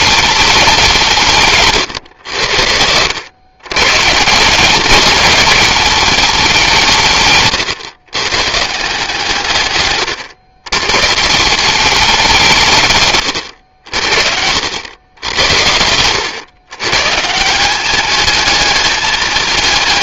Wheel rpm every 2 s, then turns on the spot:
190, 90, 180, 180, 130, 120, 170, 80, 110, 210.
none